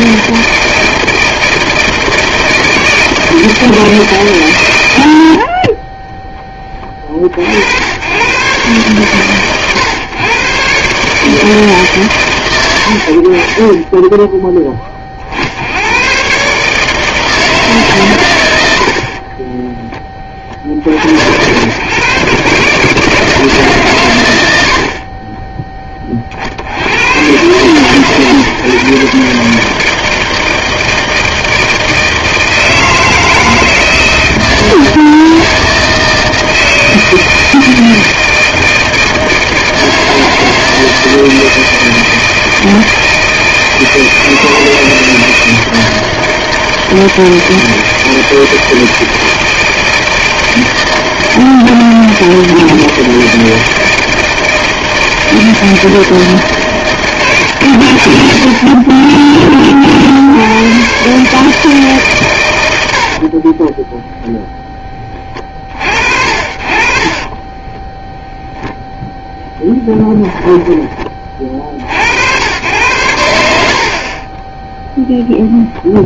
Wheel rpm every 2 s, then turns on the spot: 160, 160, 100, 20, 120, 130, 70, 30, 150, 70, 60, 150, 70, 80, 140, 160, 160, 160, 160, 160, 160, 160, 160, 160, 160, 160, 160, 160, 150, 20, 120, 80, 10, 50, 0, 20, 100, 10.
none